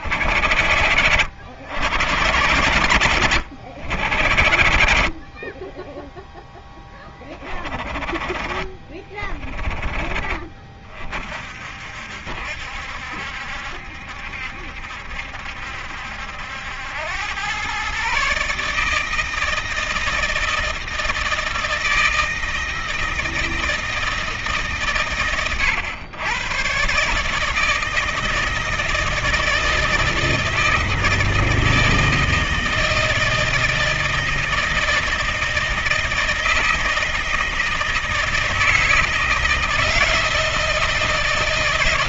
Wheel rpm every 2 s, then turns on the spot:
110, 90, 80, 10, 30, 40, 70, 70, 80, 140, 160, 160, 150, 110, 160, 160, 160, 160, 160, 160, 160.
none